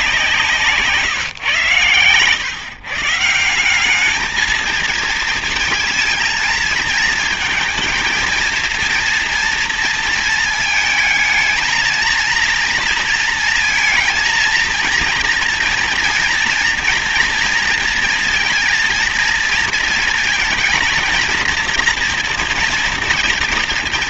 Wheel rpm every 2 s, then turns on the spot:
160, 150, 230, 220, 230, 220, 230, 230, 230, 230, 230, 230.
none